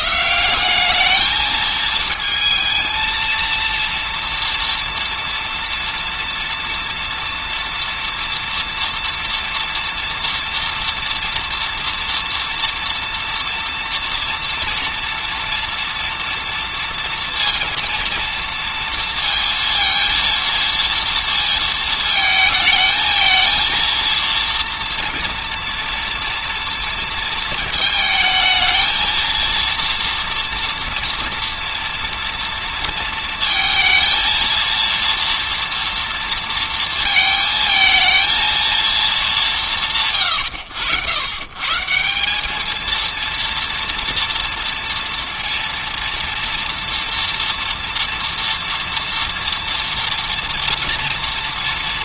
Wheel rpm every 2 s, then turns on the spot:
200, 230, 230, 230, 230, 230, 230, 230, 230, 230, 230, 220, 230, 230, 220, 230, 230, 230, 230, 220, 100, 220, 230, 230, 230, 230.
none